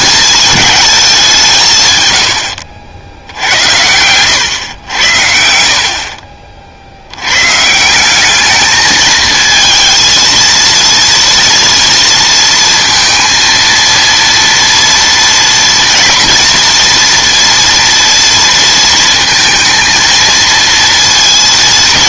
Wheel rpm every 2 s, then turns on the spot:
210, 80, 100, 50, 220, 230, 230, 230, 230, 230, 230.
none